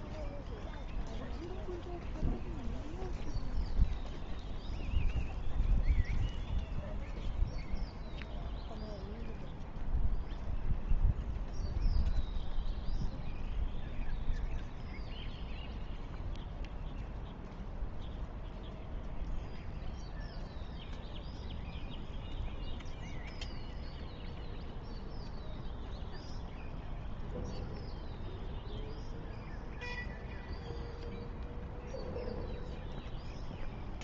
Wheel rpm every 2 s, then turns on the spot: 0, 0, 0, 0, 0, 0, 0, 0, 0, 0, 0, 0, 0, 0, 0, 0, 0.
none